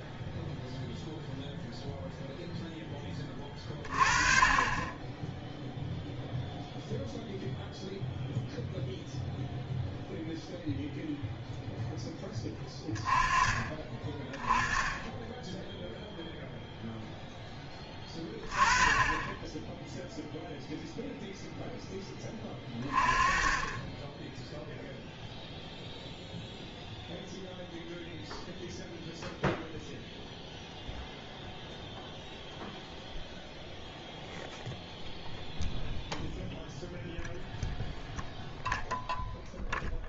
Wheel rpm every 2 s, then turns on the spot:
0, 10, 30, 0, 0, 0, 20, 20, 0, 20, 0, 20, 0, 0, 0, 0, 0, 0, 0, 0.
none